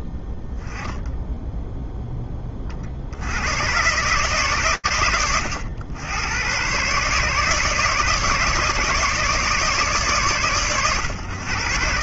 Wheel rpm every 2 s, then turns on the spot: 0, 50, 100, 130, 150, 110.
none